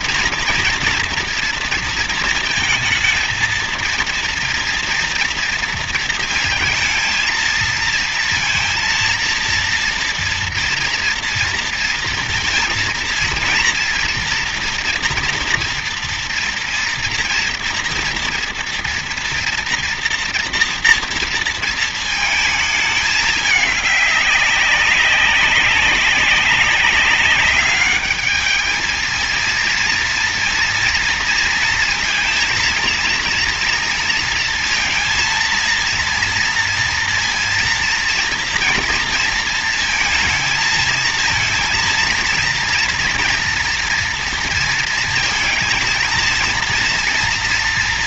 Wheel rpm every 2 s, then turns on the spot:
230, 220, 230, 230, 230, 230, 230, 240, 230, 240, 240, 220, 200, 200, 210, 230, 230, 230, 230, 230, 220, 230, 230, 230.
none